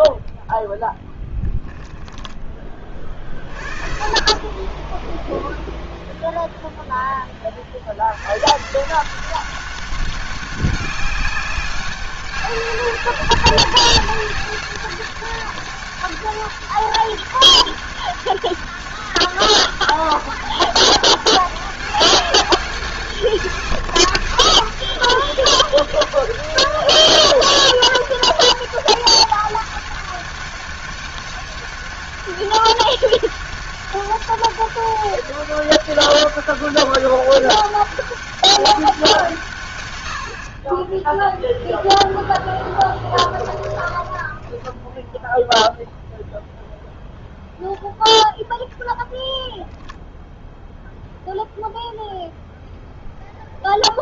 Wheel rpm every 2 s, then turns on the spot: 0, 30, 10, 0, 160, 200, 200, 190, 200, 200, 200, 190, 190, 200, 200, 200, 200, 200, 200, 190, 10, 10, 10, 0, 0, 0, 0.
none